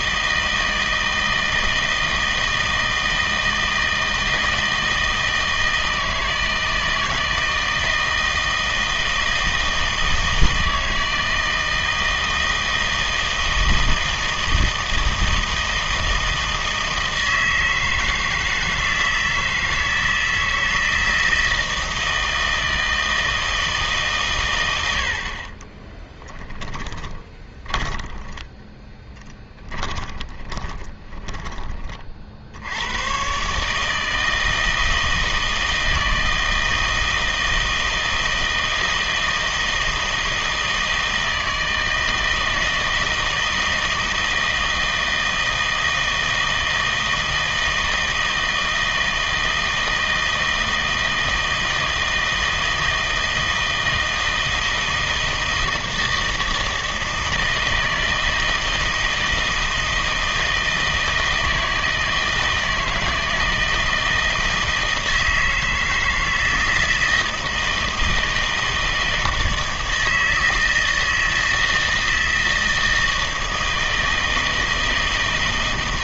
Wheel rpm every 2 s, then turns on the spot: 160, 160, 160, 160, 160, 160, 160, 160, 160, 160, 160, 160, 90, 20, 20, 20, 90, 160, 160, 160, 160, 160, 160, 160, 160, 160, 160, 160, 160, 160, 160, 160, 160, 160, 160, 160, 160, 160.
26-32